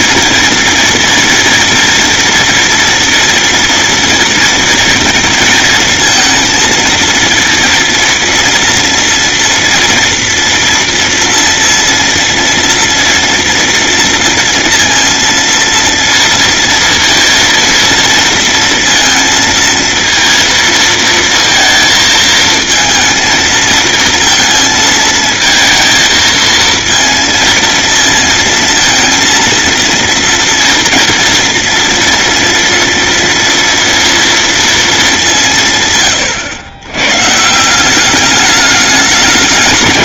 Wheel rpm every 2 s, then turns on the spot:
240, 240, 230, 230, 230, 230, 230, 230, 230, 230, 230, 230, 220, 230, 230, 230, 230, 190, 130, 210.
none